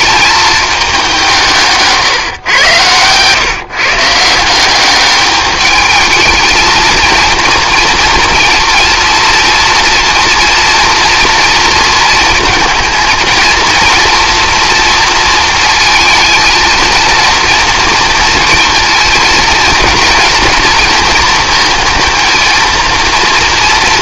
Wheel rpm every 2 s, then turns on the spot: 200, 120, 190, 230, 230, 230, 220, 230, 230, 230, 230, 230.
none